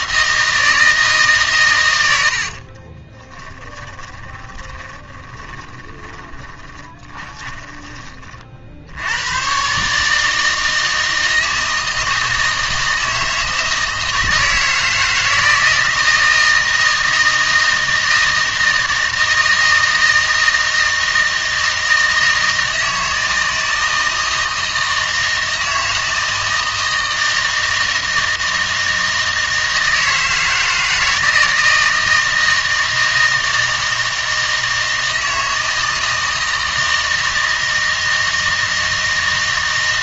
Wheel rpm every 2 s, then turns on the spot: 160, 40, 20, 30, 50, 160, 160, 160, 160, 160, 160, 160, 160, 160, 160, 160, 160, 160, 160, 160.
2-8